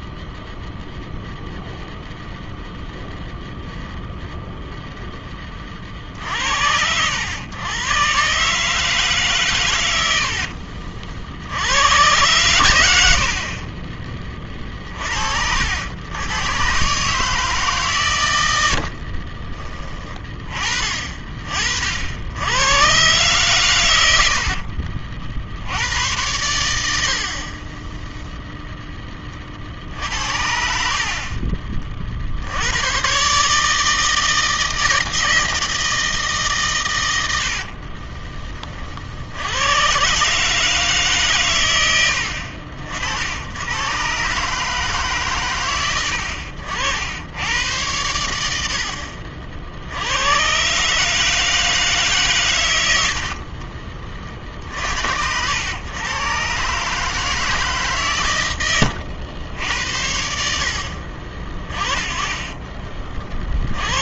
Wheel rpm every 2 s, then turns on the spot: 0, 0, 0, 70, 150, 60, 110, 30, 120, 80, 30, 100, 70, 90, 0, 60, 70, 160, 140, 30, 150, 70, 140, 70, 80, 130, 120, 50, 130, 110, 60, 30.
10-12 18-20 24-26